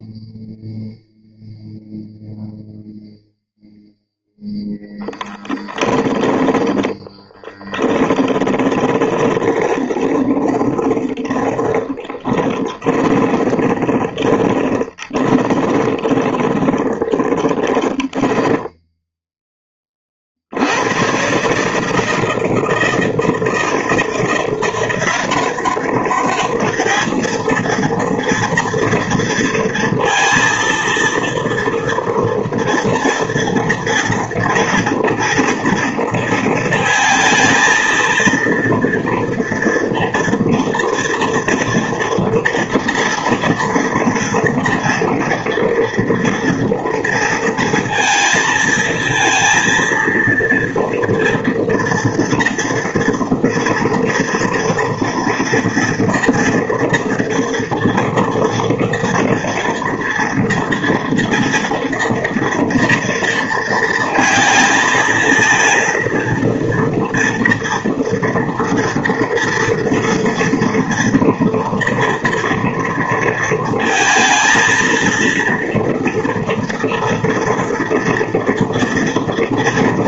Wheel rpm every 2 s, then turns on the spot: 0, 0, 0, 10, 20, 20, 10, 20, 20, 20, 70, 160, 170, 210, 230, 230, 230, 230, 230, 230, 240, 230, 240, 230, 230, 230, 230, 230, 230, 240, 230, 230, 220, 230, 230, 230, 230, 230, 230, 230.
6-20